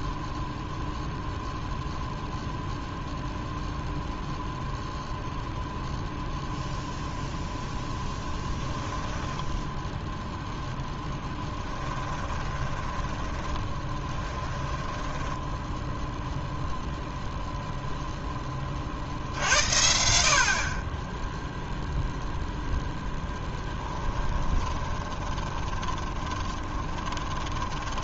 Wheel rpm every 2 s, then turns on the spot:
0, 0, 0, 0, 10, 0, 20, 10, 0, 20, 50, 10, 20, 20.
8-10 12-16 24-28